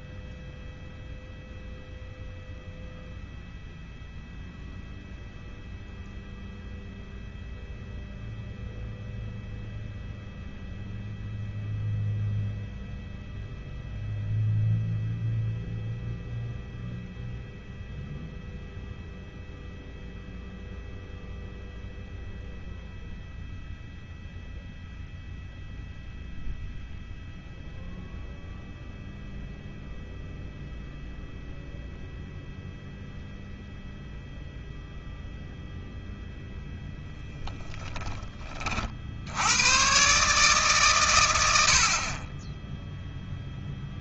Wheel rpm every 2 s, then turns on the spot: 0, 0, 0, 0, 0, 0, 0, 0, 0, 0, 0, 0, 0, 0, 0, 0, 0, 0, 0, 50, 110, 0.
none